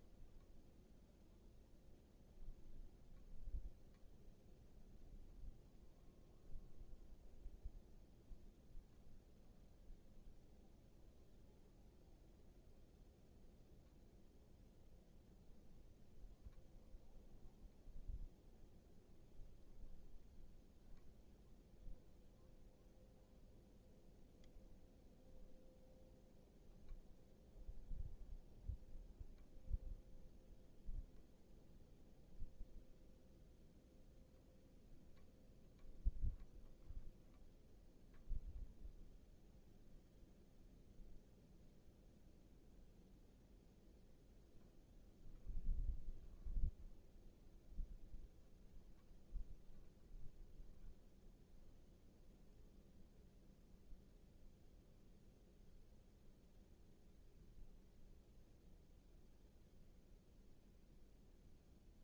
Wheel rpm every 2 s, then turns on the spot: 0, 0, 0, 0, 0, 0, 0, 0, 0, 0, 0, 0, 0, 0, 0, 0, 0, 0, 0, 0, 0, 0, 0, 0, 0, 0, 0, 0, 0, 0, 0.
none